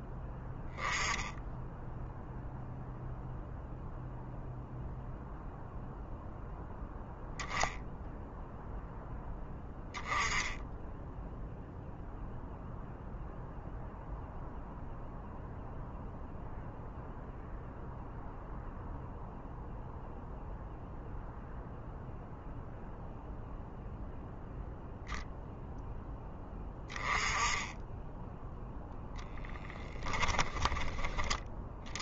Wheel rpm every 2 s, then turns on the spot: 10, 0, 0, 0, 0, 10, 0, 0, 0, 0, 0, 0, 0, 10, 0, 10.
none